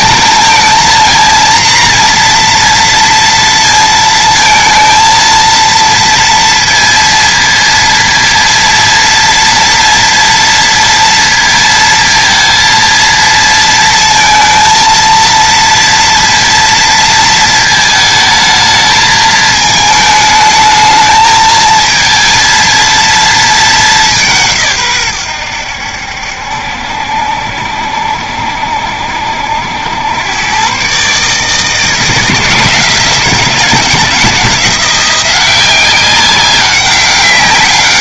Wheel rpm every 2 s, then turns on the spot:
230, 230, 230, 230, 230, 230, 230, 230, 230, 220, 220, 230, 140, 70, 70, 120, 160, 170, 200.
none